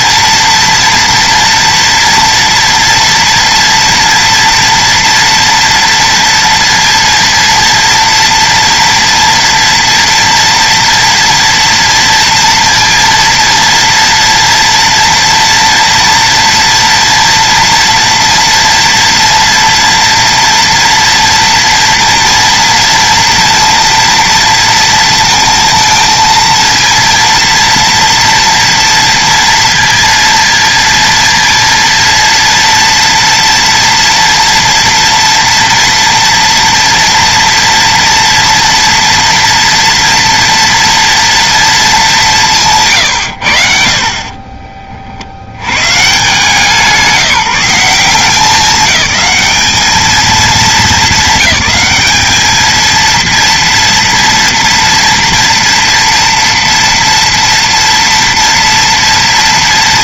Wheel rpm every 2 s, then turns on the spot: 230, 230, 230, 230, 230, 230, 230, 230, 230, 230, 240, 230, 230, 230, 230, 230, 230, 230, 240, 230, 230, 200, 40, 150, 190, 220, 210, 230, 230, 230.
44-46